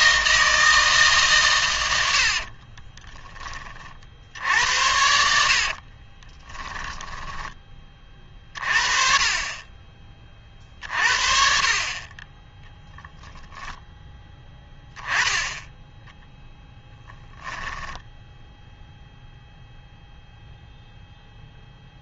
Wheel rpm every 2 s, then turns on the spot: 160, 20, 80, 10, 40, 40, 0, 10, 0, 0, 0.
2-4 6-8